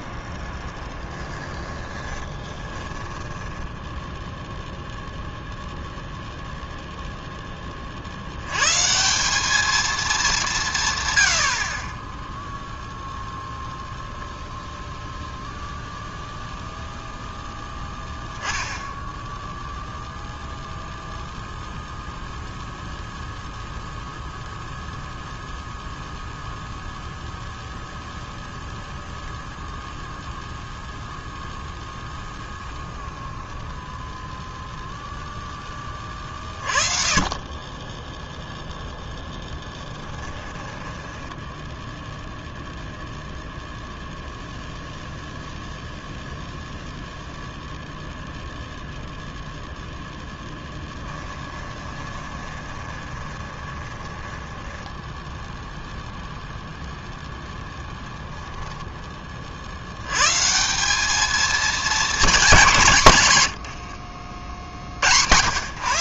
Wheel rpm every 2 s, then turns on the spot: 0, 30, 0, 0, 140, 140, 0, 0, 0, 10, 0, 0, 0, 0, 0, 0, 0, 0, 30, 0, 10, 0, 0, 0, 0, 10, 20, 10, 0, 10, 180, 180, 70.
2-4 40-42 50-56